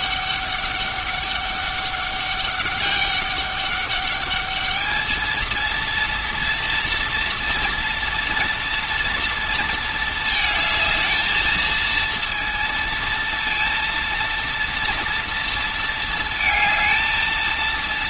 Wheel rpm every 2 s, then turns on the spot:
200, 200, 210, 240, 240, 220, 230, 230, 230.
none